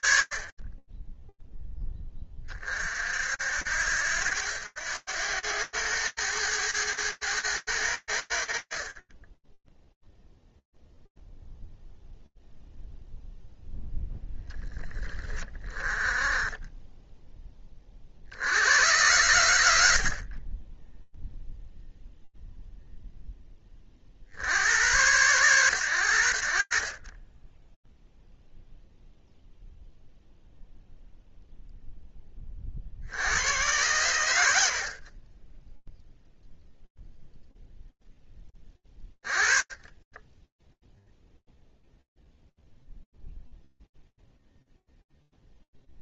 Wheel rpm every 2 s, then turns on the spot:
30, 20, 80, 100, 80, 0, 0, 10, 10, 90, 10, 0, 80, 80, 0, 0, 60, 60, 0, 20, 0, 0, 0.
none